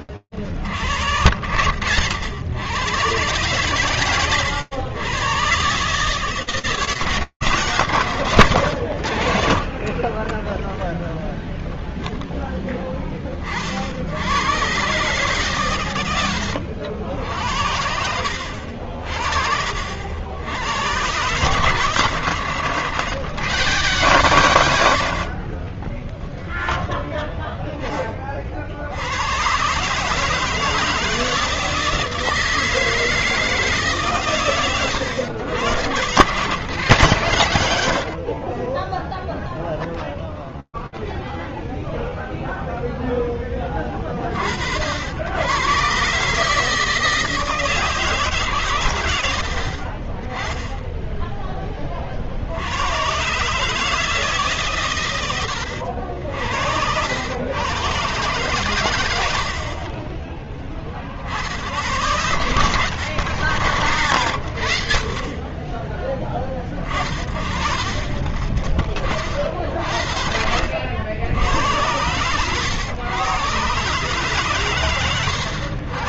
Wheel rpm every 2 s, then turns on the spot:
30, 90, 120, 140, 140, 30, 0, 100, 100, 70, 90, 110, 110, 0, 70, 160, 160, 120, 130, 0, 0, 30, 110, 160, 60, 10, 150, 100, 100, 100, 60, 90, 20, 30, 50, 90, 120, 100.
62-64